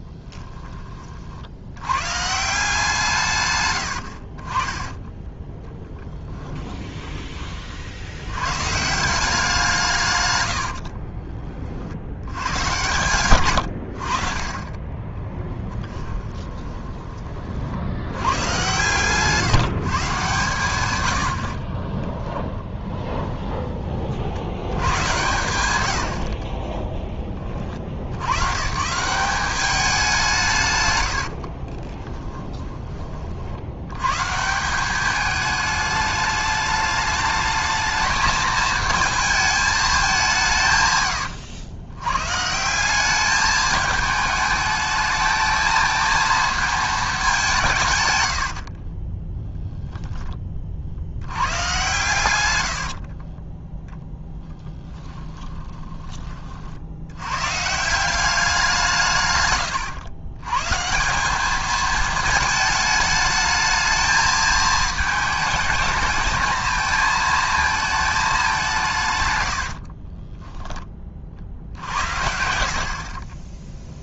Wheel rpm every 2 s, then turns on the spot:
20, 160, 30, 10, 130, 90, 100, 40, 20, 120, 130, 10, 90, 30, 130, 130, 20, 170, 210, 220, 140, 170, 210, 220, 70, 40, 90, 10, 60, 180, 140, 220, 220, 220, 190, 20, 80.
6-8 10-12 16-18 22-24 26-28 48-50 52-56